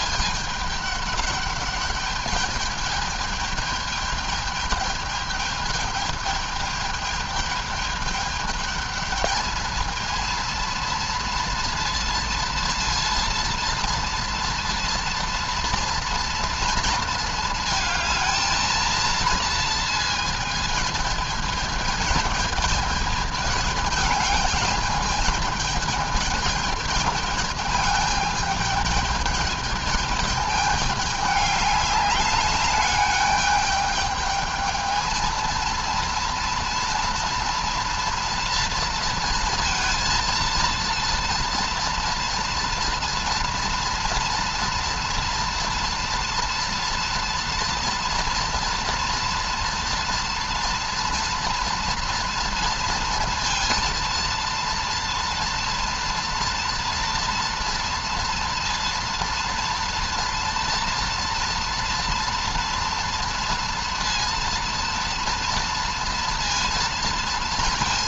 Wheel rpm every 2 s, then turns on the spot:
210, 210, 210, 210, 210, 230, 230, 230, 230, 230, 220, 210, 210, 220, 210, 210, 200, 220, 230, 230, 230, 230, 230, 230, 230, 230, 230, 230, 240, 230, 230, 230, 230, 230.
none